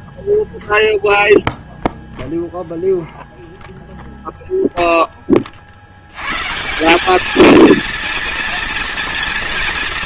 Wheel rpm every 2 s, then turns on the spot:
0, 0, 0, 150, 230.
none